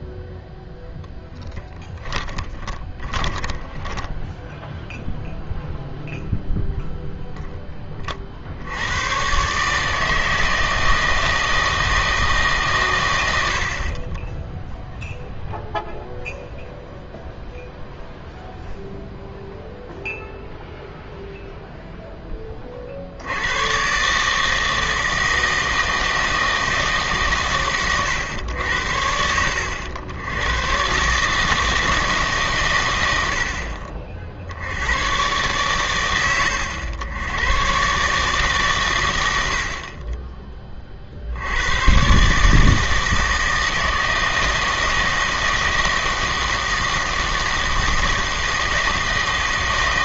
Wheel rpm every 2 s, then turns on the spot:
0, 20, 0, 0, 70, 160, 140, 0, 0, 0, 0, 30, 160, 160, 80, 120, 130, 80, 100, 130, 20, 150, 160, 160, 160.
2-4